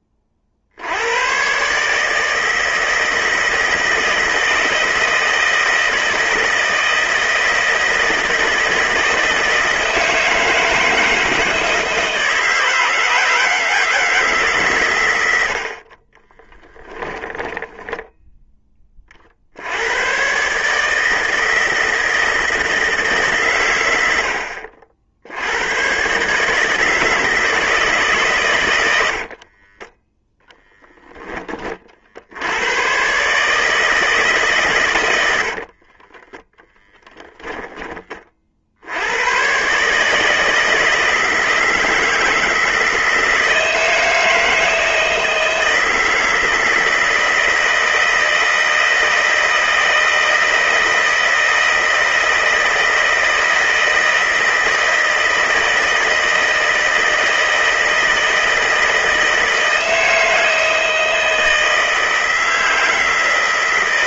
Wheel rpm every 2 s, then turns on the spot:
60, 160, 160, 160, 160, 160, 160, 130, 10, 20, 140, 160, 70, 150, 110, 10, 100, 130, 10, 60, 160, 160, 160, 160, 160, 160, 160, 160, 160, 160, 160, 160.
16-18 36-38